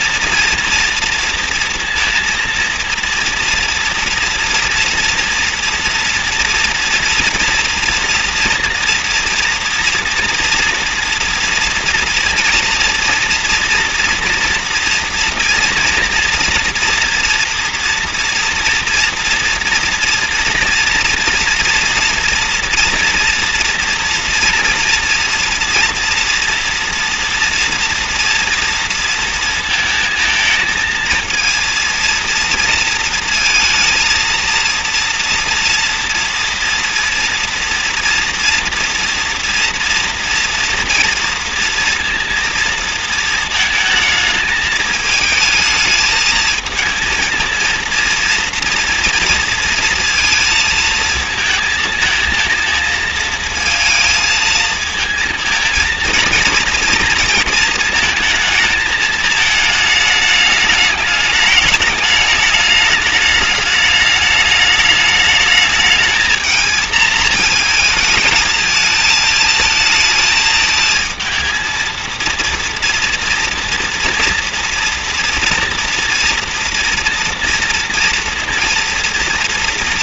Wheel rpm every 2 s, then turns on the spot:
230, 230, 230, 230, 240, 230, 230, 240, 230, 230, 230, 230, 230, 240, 230, 220, 230, 230, 230, 230, 230, 230, 220, 220, 230, 220, 230, 220, 230, 220, 210, 210, 210, 220, 220, 220, 230, 230, 230, 230.
none